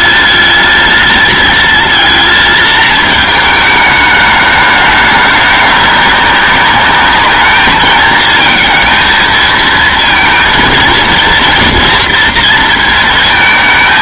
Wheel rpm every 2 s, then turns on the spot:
230, 220, 210, 210, 230, 230, 230.
none